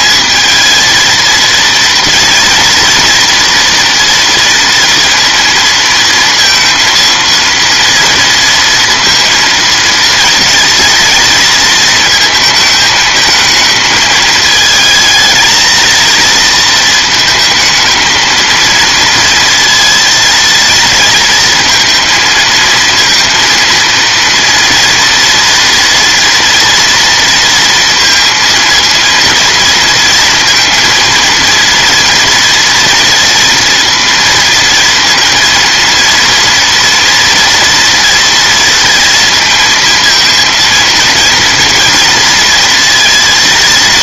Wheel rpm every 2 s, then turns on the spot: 220, 230, 230, 230, 230, 230, 220, 220, 230, 230, 220, 230, 230, 230, 230, 230, 230, 230, 230, 230, 230, 230.
none